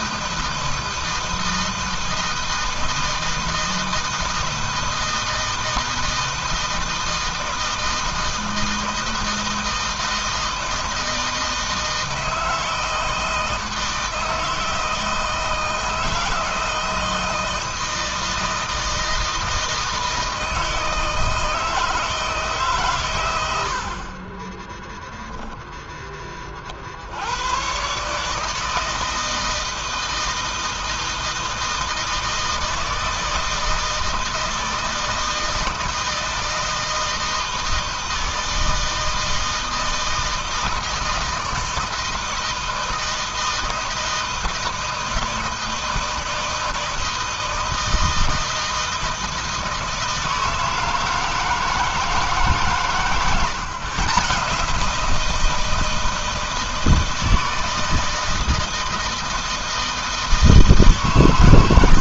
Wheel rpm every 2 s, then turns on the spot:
160, 160, 160, 160, 160, 160, 160, 160, 160, 160, 160, 150, 20, 40, 150, 160, 160, 160, 160, 160, 160, 160, 160, 160, 160, 160, 140, 150, 160, 160, 150.
none